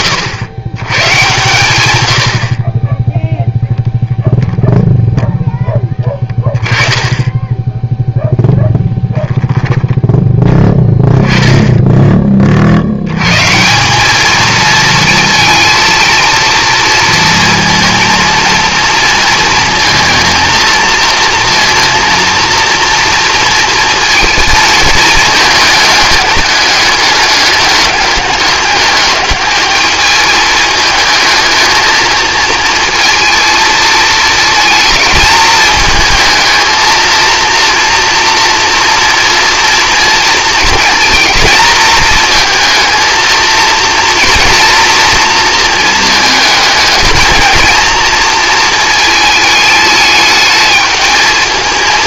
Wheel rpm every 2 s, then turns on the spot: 120, 30, 0, 20, 10, 10, 70, 230, 230, 230, 230, 230, 220, 210, 210, 220, 230, 220, 230, 230, 230, 230, 230, 220, 230, 220.
none